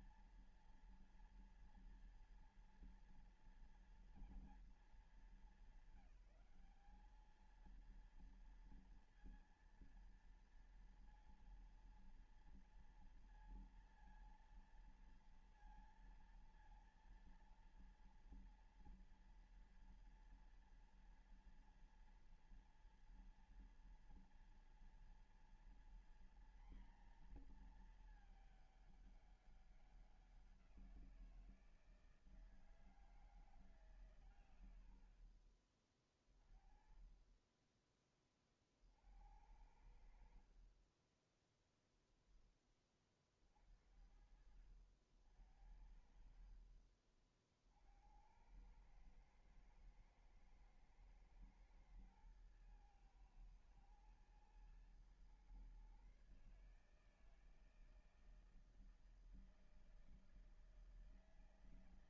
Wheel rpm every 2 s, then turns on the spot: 230, 230, 230, 190, 230, 230, 230, 230, 230, 230, 230, 230, 230, 240, 220, 190, 160, 120, 40, 30, 60, 10, 60, 50, 90, 110, 110, 110, 140, 160, 160.
40-42 46-48